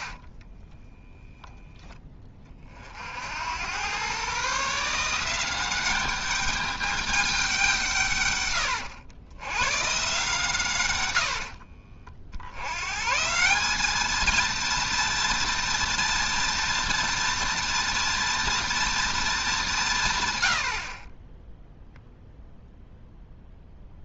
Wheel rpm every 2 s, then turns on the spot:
10, 40, 150, 200, 110, 120, 100, 230, 240, 230, 70, 0.
0-2